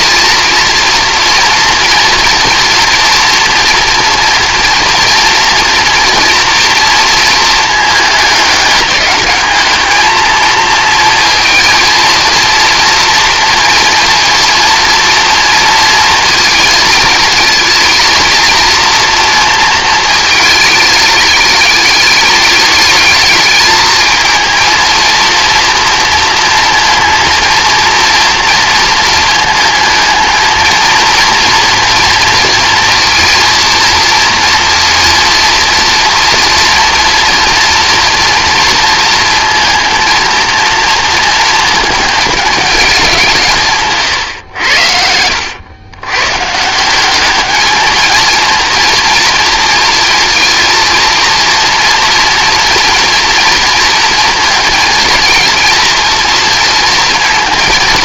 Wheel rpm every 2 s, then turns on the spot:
230, 240, 230, 230, 210, 220, 230, 240, 230, 230, 210, 210, 230, 230, 220, 220, 230, 230, 230, 230, 230, 200, 80, 170, 230, 230, 230, 230, 220.
none